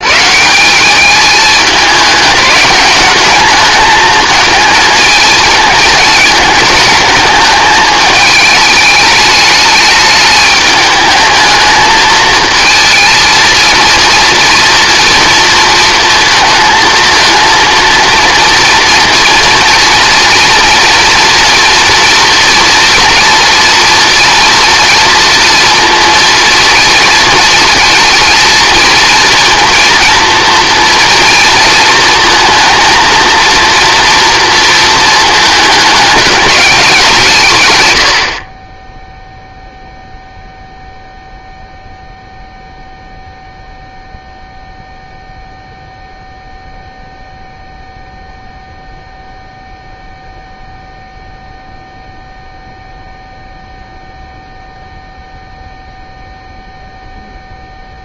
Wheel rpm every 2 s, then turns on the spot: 180, 200, 220, 210, 210, 210, 220, 230, 220, 230, 230, 230, 230, 220, 230, 230, 230, 230, 200, 20, 0, 0, 0, 0, 0, 0, 0, 0, 0.
none